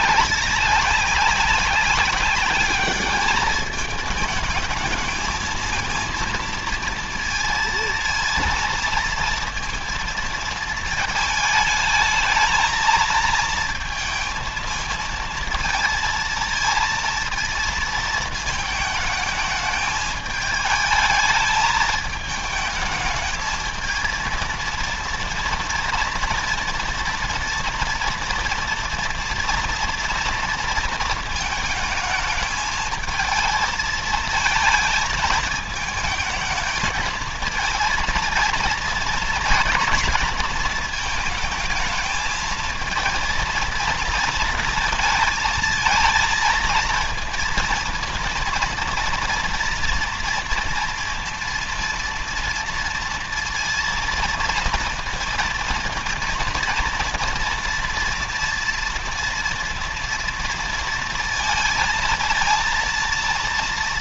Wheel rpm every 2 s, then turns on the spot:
190, 200, 220, 230, 230, 230, 220, 220, 230, 220, 220, 220, 230, 240, 240, 230, 220, 220, 220, 230, 210, 220, 230, 230, 230, 240, 240, 230, 230, 230, 230, 230.
none